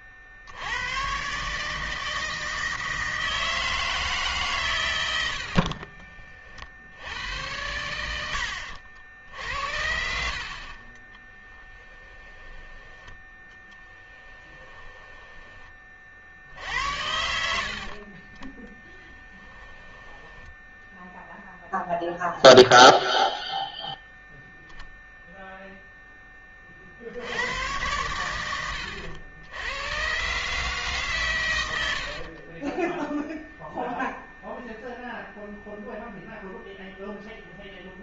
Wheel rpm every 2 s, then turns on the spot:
90, 160, 130, 60, 80, 40, 10, 10, 70, 10, 10, 0, 0, 30, 100, 150, 20, 0, 0.
8-16 18-22 32-34